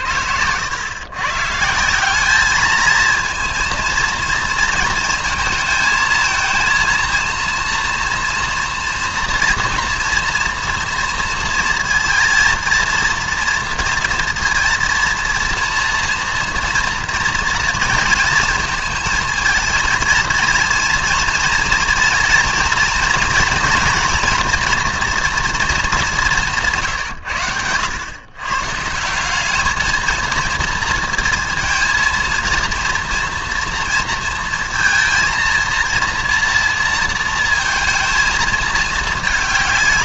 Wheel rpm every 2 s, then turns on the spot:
100, 220, 230, 220, 230, 230, 230, 230, 230, 220, 230, 230, 240, 160, 140, 230, 230, 230, 230, 220.
none